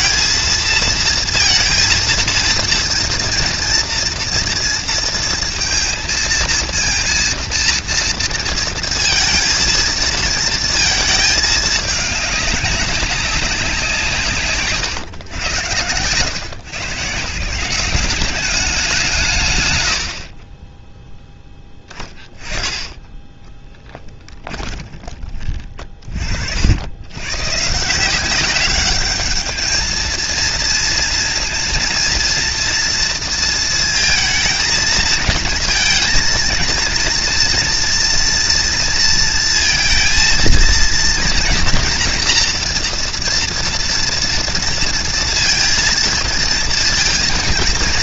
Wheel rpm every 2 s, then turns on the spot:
230, 230, 230, 230, 230, 220, 200, 130, 140, 180, 10, 10, 20, 80, 200, 230, 230, 220, 230, 230, 230, 230, 230, 230.
24-26